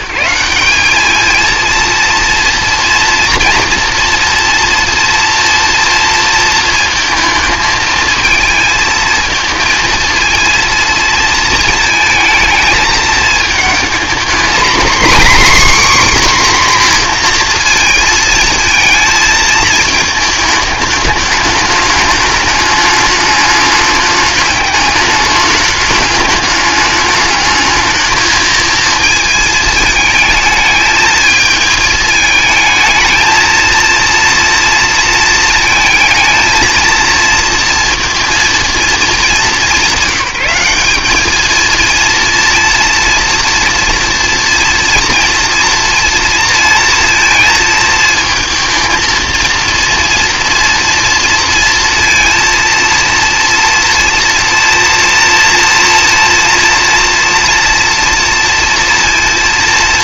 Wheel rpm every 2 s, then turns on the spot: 190, 240, 230, 230, 230, 230, 220, 250, 260, 230, 210, 210, 210, 210, 220, 220, 220, 230, 230, 230, 200, 230, 230, 230, 220, 230, 230, 230, 230, 230.
none